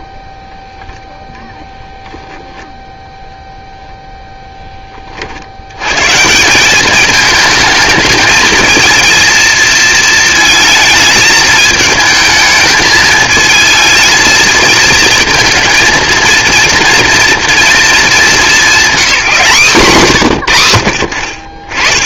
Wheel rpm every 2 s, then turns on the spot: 0, 0, 10, 190, 230, 220, 220, 230, 230, 210, 100.
none